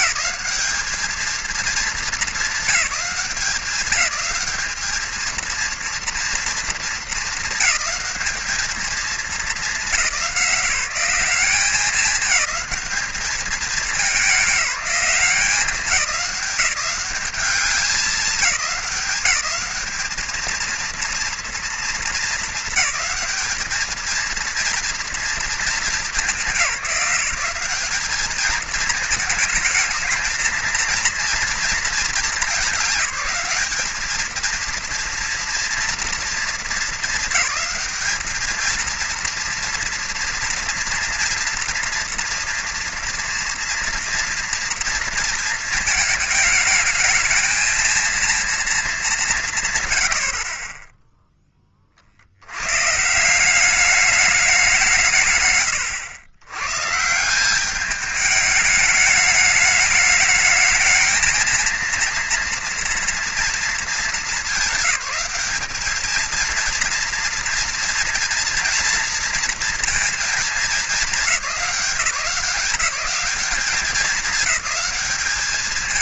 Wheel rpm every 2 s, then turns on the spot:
220, 190, 220, 220, 220, 190, 210, 190, 200, 200, 230, 210, 230, 190, 220, 230, 210, 230, 210, 230, 230, 240, 230, 220, 170, 10, 160, 160, 150, 210, 220, 230, 200, 230, 230, 210, 190, 210.
none